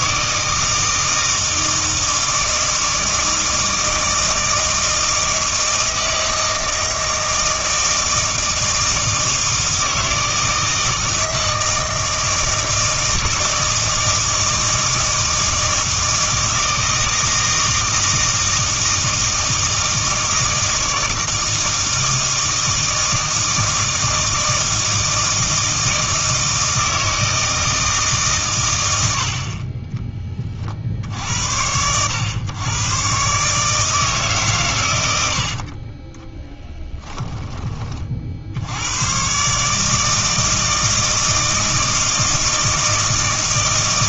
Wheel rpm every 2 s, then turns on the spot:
160, 160, 160, 160, 160, 160, 160, 160, 160, 160, 160, 160, 160, 160, 100, 50, 120, 110, 10, 80, 160, 160.
36-38